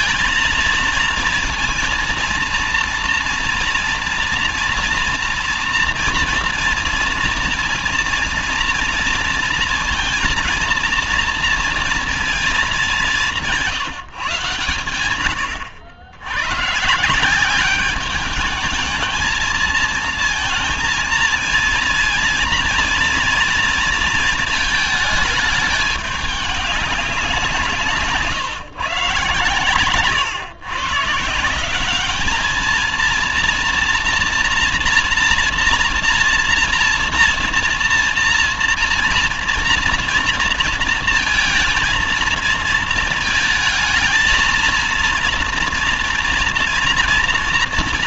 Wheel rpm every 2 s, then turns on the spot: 230, 230, 230, 230, 230, 230, 210, 120, 130, 220, 230, 230, 220, 200, 140, 130, 220, 230, 230, 230, 230, 230, 220, 230.
none